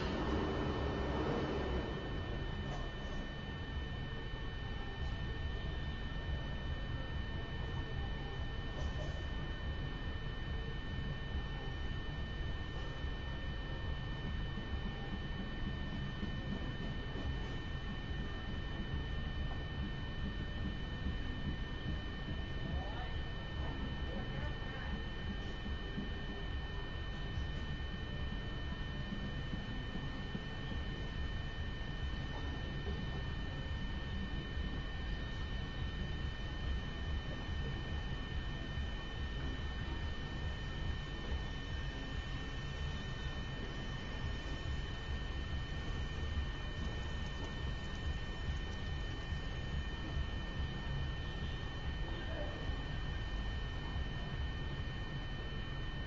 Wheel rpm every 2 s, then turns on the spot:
0, 0, 0, 0, 0, 0, 0, 0, 0, 0, 0, 0, 0, 0, 0, 0, 0, 0, 0, 0, 0, 0, 0, 0, 0, 0, 0, 0.
none